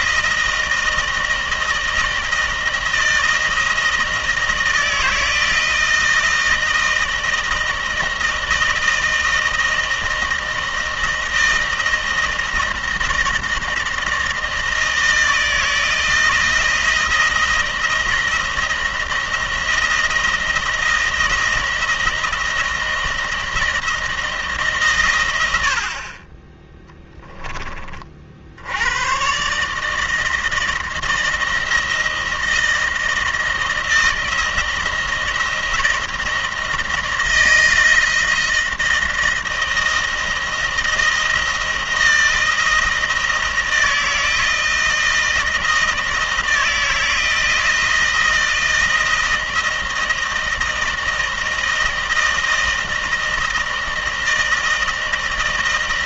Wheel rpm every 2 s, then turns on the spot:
160, 160, 160, 160, 160, 160, 160, 160, 160, 160, 160, 160, 150, 20, 70, 160, 160, 160, 160, 160, 160, 160, 160, 160, 160, 160, 160, 160.
none